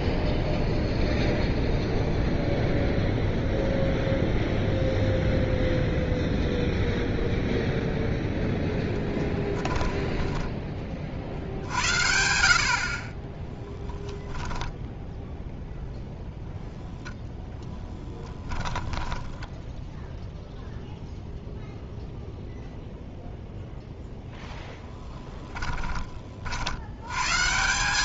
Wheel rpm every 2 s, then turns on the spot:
0, 0, 0, 10, 50, 20, 0, 0, 20, 0, 0, 0, 20, 180.
6-8 16-18